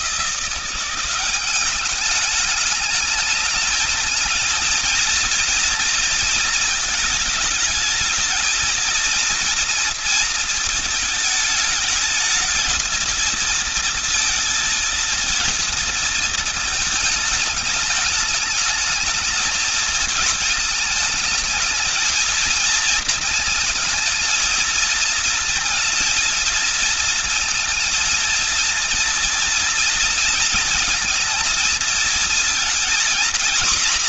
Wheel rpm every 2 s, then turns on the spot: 180, 210, 230, 230, 230, 230, 220, 220, 220, 210, 220, 230, 220, 230, 230, 230, 230.
none